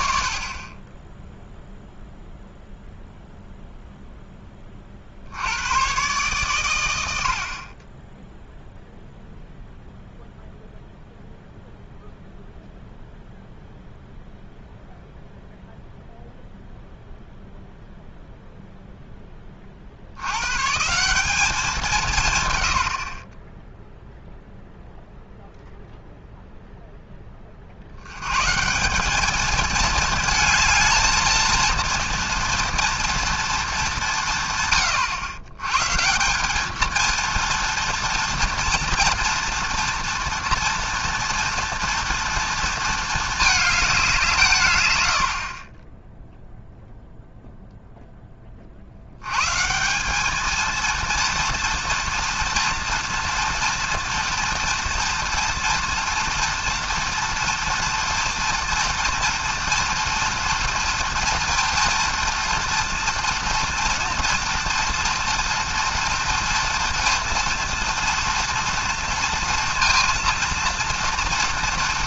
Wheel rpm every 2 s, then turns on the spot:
0, 0, 70, 70, 0, 0, 0, 0, 0, 20, 190, 40, 0, 20, 210, 230, 230, 110, 230, 230, 240, 220, 70, 0, 120, 230, 230, 230, 240, 230, 230, 230, 230, 230, 230, 240.
none